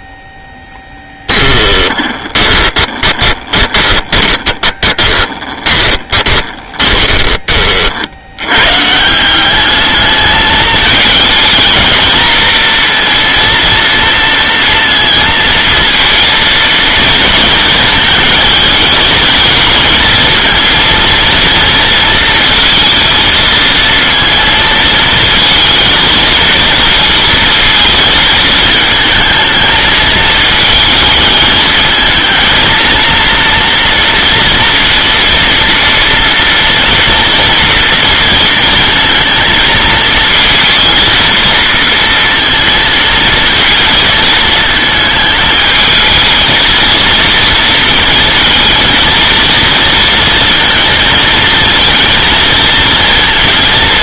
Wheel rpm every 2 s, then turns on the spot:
10, 20, 20, 20, 160, 220, 230, 230, 230, 220, 230, 230, 230, 230, 220, 220, 230, 230, 230, 230, 230, 220, 220, 230, 230, 230, 230.
0-8